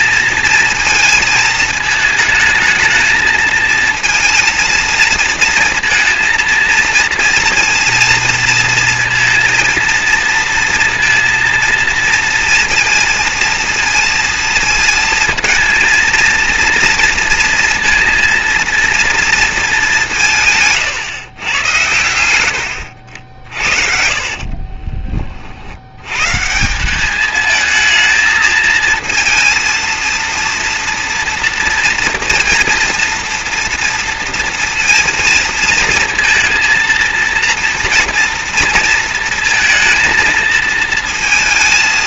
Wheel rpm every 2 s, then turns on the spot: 230, 220, 220, 230, 230, 230, 230, 230, 230, 230, 140, 70, 30, 190, 220, 230, 230, 230, 230, 230, 230.
22-26